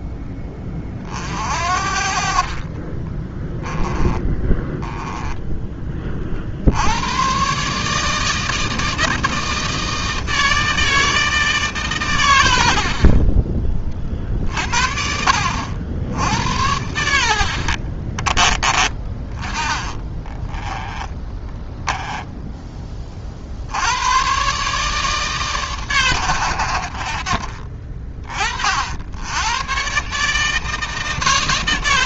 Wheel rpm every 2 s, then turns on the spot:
20, 30, 10, 70, 160, 160, 70, 50, 90, 20, 10, 10, 140, 70, 60, 160.
2-6 12-14 18-22